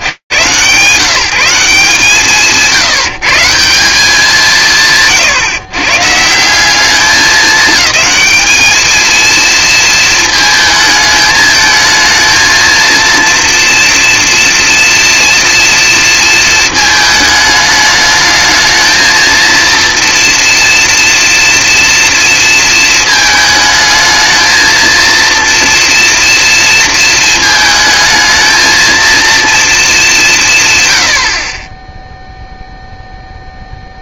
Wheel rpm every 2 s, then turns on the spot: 80, 160, 180, 190, 220, 220, 220, 230, 220, 220, 230, 230, 220, 240, 230, 190, 0.
none